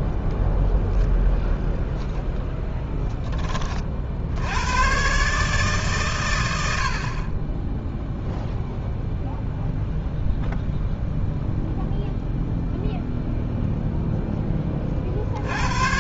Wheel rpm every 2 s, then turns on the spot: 10, 10, 80, 100, 0, 0, 0, 10.
0-4